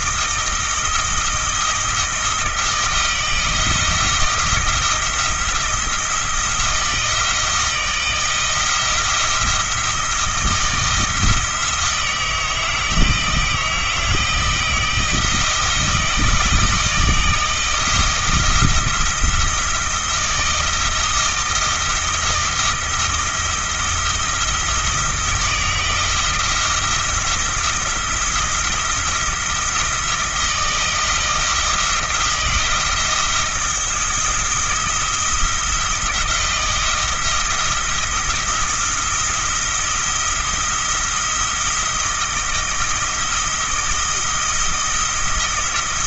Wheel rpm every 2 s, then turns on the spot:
160, 170, 170, 170, 170, 170, 160, 170, 160, 170, 170, 160, 160, 170, 170, 160, 170, 170, 170, 170, 170, 160, 170.
none